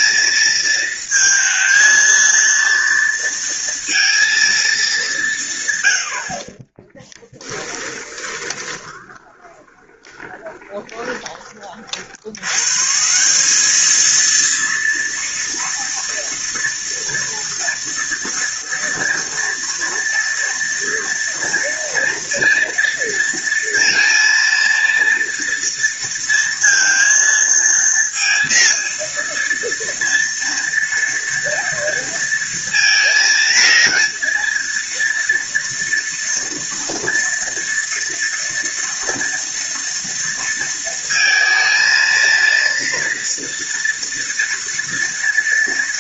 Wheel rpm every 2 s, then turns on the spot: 230, 230, 180, 10, 20, 20, 180, 230, 230, 230, 230, 230, 230, 230, 230, 230, 230, 230, 230, 230, 230, 230, 230.
6-10